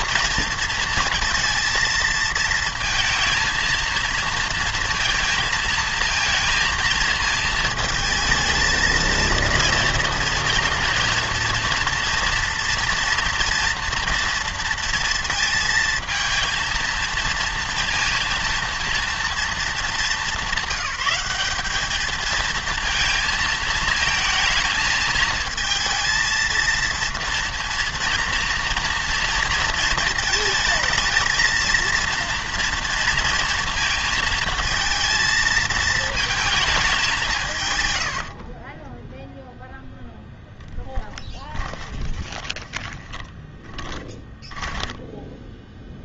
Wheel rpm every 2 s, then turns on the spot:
230, 220, 230, 230, 220, 230, 230, 230, 230, 230, 200, 220, 220, 230, 230, 220, 230, 230, 220, 30, 10, 20, 10.
38-40 42-46